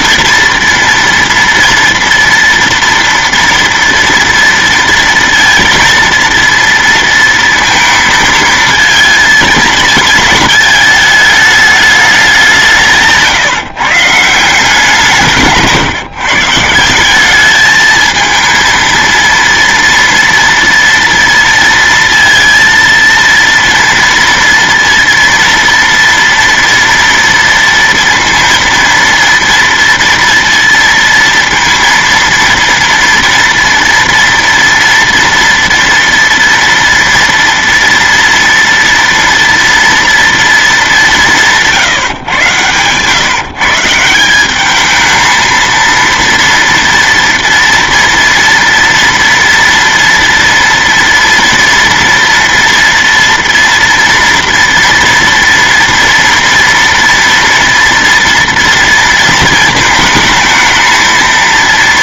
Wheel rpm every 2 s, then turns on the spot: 230, 230, 230, 230, 230, 220, 170, 170, 170, 230, 230, 230, 230, 230, 230, 230, 240, 230, 230, 230, 210, 120, 210, 230, 230, 230, 240, 230, 230, 230, 220.
none